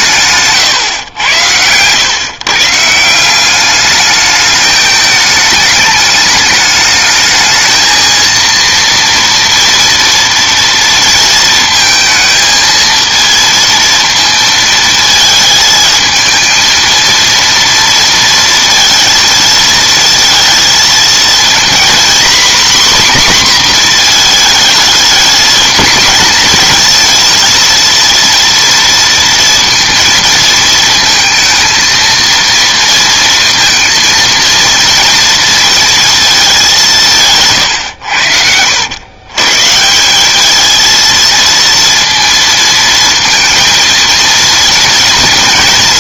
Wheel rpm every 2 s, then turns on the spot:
100, 170, 210, 220, 230, 230, 230, 220, 230, 230, 230, 250, 220, 230, 230, 220, 230, 230, 160, 110, 230, 220, 230.
none